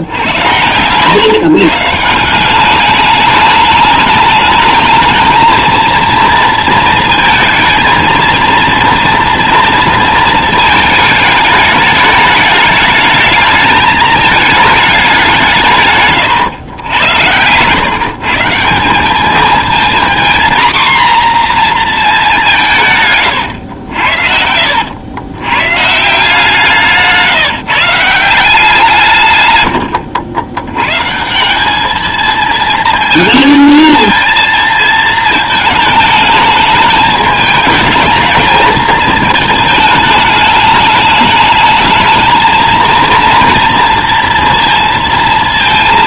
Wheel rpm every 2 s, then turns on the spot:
110, 200, 220, 230, 230, 220, 210, 210, 100, 180, 240, 160, 80, 160, 150, 120, 230, 230, 220, 220, 210, 230, 230.
none